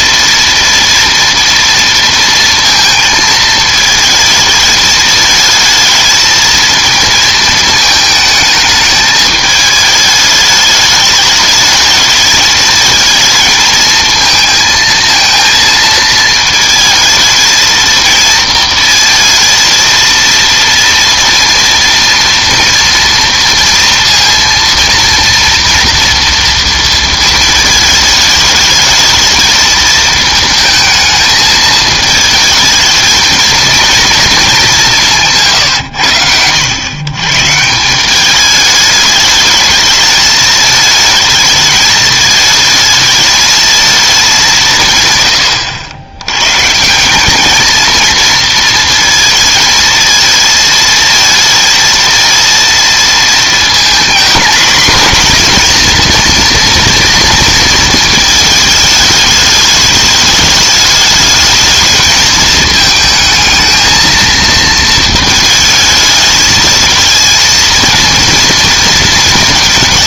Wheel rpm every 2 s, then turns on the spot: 240, 230, 220, 220, 220, 210, 220, 220, 220, 230, 230, 230, 230, 230, 210, 220, 220, 190, 90, 210, 220, 220, 180, 150, 230, 220, 230, 240, 230, 220, 210, 220, 230, 220, 230.
none